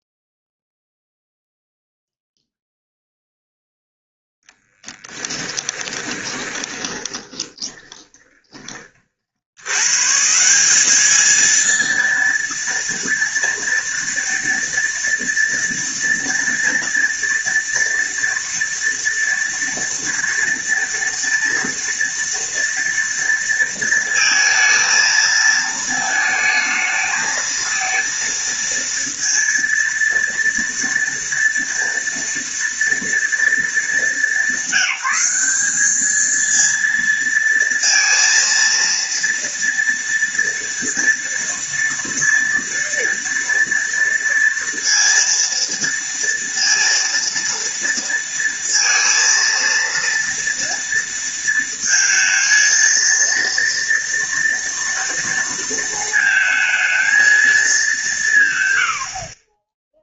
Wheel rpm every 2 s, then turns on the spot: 0, 0, 0, 20, 20, 170, 230, 230, 230, 230, 230, 230, 220, 220, 230, 230, 230, 200, 230, 230, 230, 230, 230, 230, 230, 230, 230, 230, 220, 140.
6-10